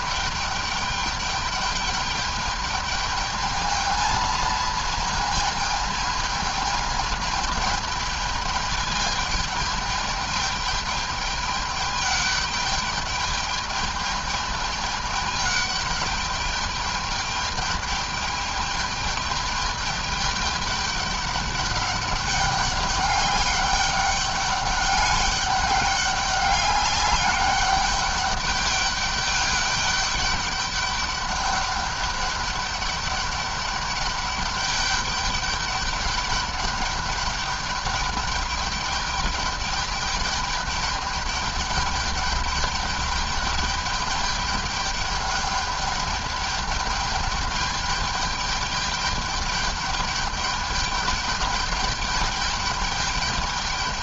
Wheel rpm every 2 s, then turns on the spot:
210, 210, 220, 220, 210, 210, 210, 210, 210, 210, 210, 200, 200, 200, 200, 200, 200, 200, 200, 210, 210, 210, 210, 210, 210, 210, 210.
none